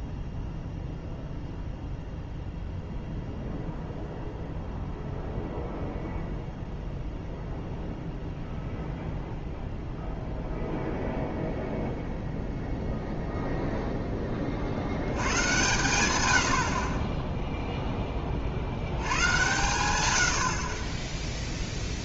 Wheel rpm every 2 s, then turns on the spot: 0, 0, 0, 0, 0, 0, 0, 50, 60, 50, 50.
none